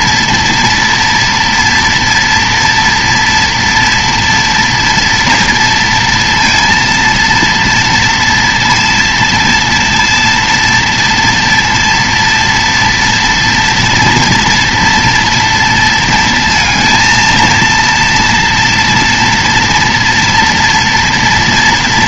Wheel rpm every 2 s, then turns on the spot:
230, 230, 230, 230, 230, 230, 230, 230, 230, 240, 230.
none